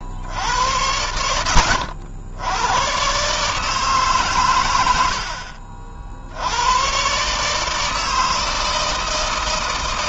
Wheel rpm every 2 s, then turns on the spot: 80, 110, 90, 100, 160.
none